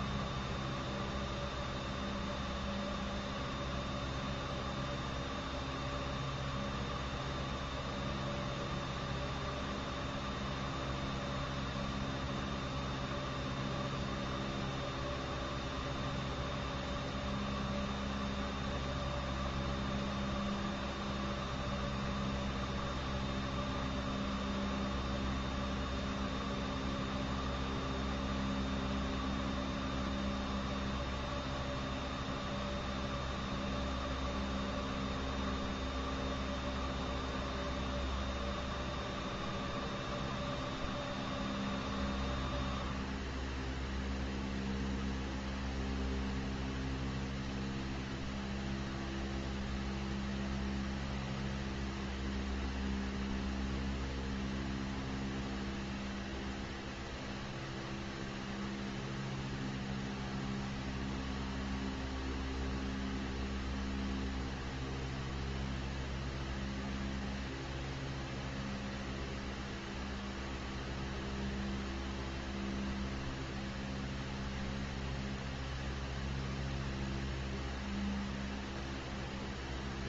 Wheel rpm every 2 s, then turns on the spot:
0, 0, 0, 0, 0, 0, 0, 0, 0, 0, 0, 0, 0, 0, 0, 0, 0, 0, 0, 0, 0, 0, 0, 0, 0, 0, 0, 0, 0, 0, 0, 0, 0, 0, 0, 0, 0, 0, 0, 0.
none